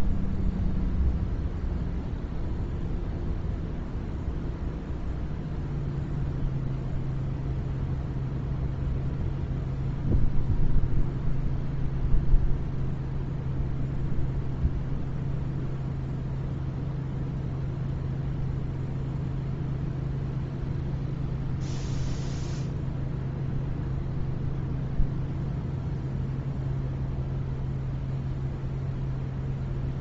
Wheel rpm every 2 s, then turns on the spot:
0, 0, 0, 0, 0, 0, 0, 0, 0, 0, 0, 0, 0, 0, 0.
none